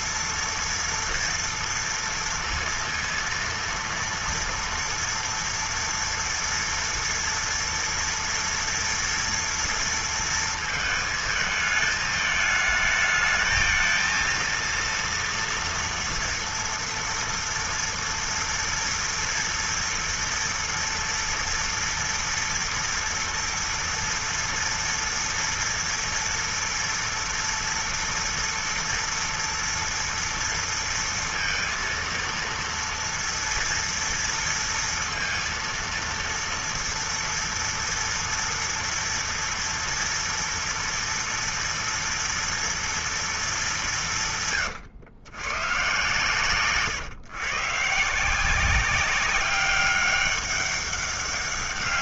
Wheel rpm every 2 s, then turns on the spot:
230, 230, 230, 230, 230, 230, 220, 230, 240, 240, 230, 230, 230, 240, 240, 230, 230, 230, 230, 230, 230, 230, 160, 130, 160, 200.
none